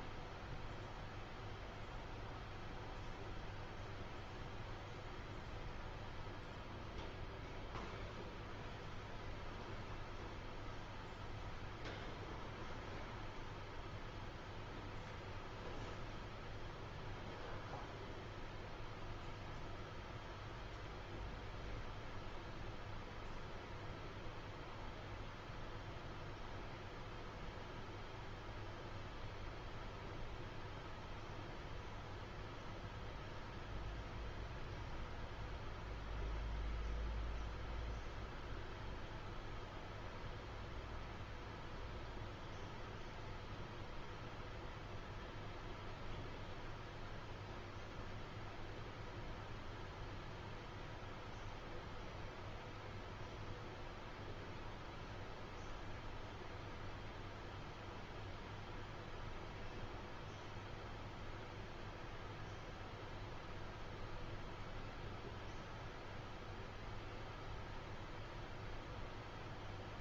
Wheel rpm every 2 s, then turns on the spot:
0, 0, 0, 0, 0, 0, 0, 0, 0, 0, 0, 0, 0, 0, 0, 0, 0, 0, 0, 0, 0, 0, 0, 0, 0, 0, 0, 0, 0, 0, 0, 0, 0, 0, 0.
none